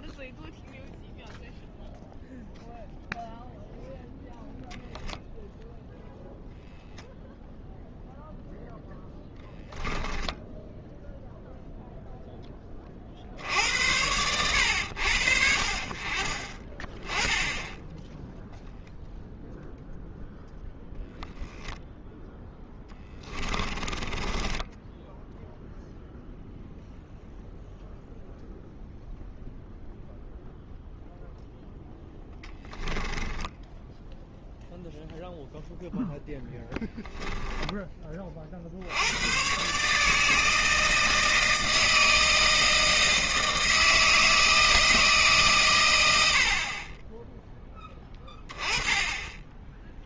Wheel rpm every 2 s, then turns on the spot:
0, 0, 0, 0, 0, 10, 20, 90, 30, 0, 0, 0, 10, 0, 0, 0, 10, 0, 10, 50, 160, 160, 160, 60, 20.
10-12 24-26 32-34 36-38